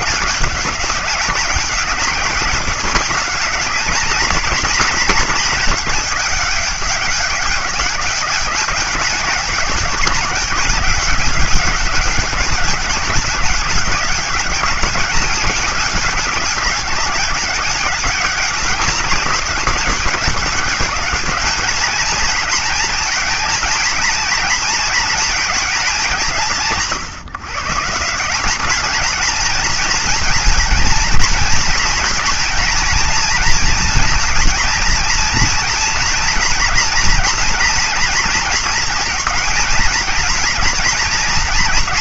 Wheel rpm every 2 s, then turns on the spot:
200, 200, 220, 200, 200, 190, 190, 200, 190, 200, 200, 220, 230, 170, 200, 230, 230, 230, 240, 230, 230.
none